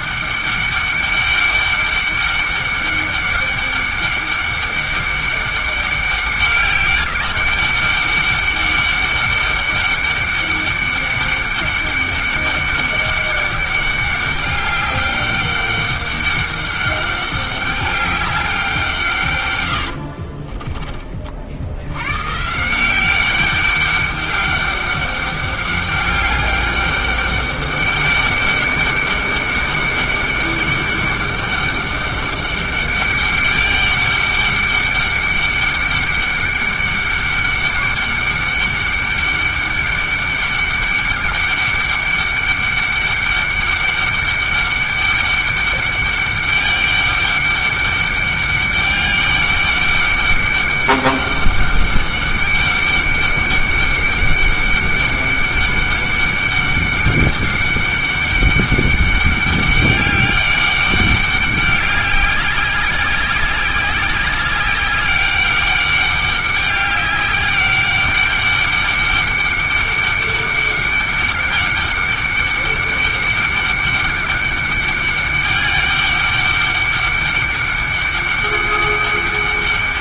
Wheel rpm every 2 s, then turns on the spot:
200, 200, 200, 200, 200, 200, 200, 200, 200, 170, 30, 180, 200, 200, 200, 200, 200, 200, 200, 200, 200, 200, 200, 200, 200, 200, 200, 200, 200, 200, 200, 190, 200, 200, 200, 200, 200, 200, 200, 200.
none